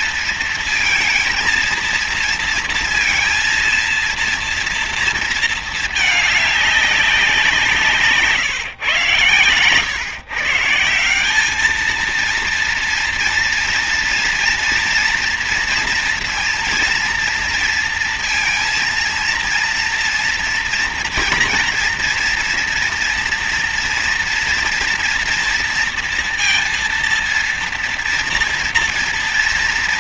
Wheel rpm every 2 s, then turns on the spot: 230, 230, 230, 210, 150, 130, 230, 230, 230, 230, 230, 230, 230, 230, 230.
none